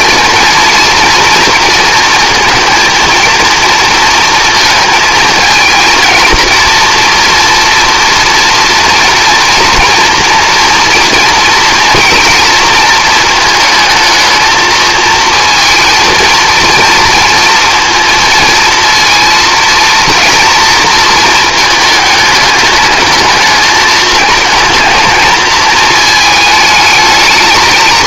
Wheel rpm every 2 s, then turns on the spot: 240, 230, 230, 230, 230, 230, 220, 220, 230, 230, 230, 220, 220, 220.
none